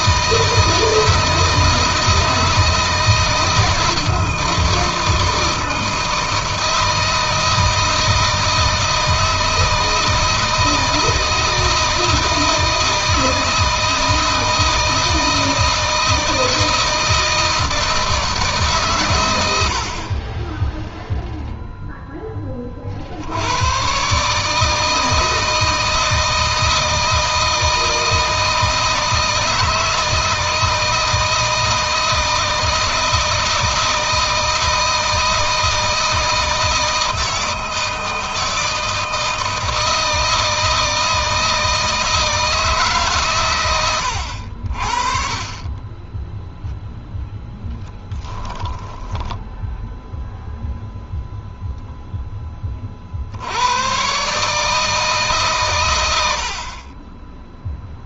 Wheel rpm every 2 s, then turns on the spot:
160, 160, 160, 160, 160, 160, 160, 160, 160, 130, 0, 40, 160, 160, 160, 160, 160, 160, 160, 160, 160, 150, 60, 10, 20, 0, 40, 150, 30.
48-50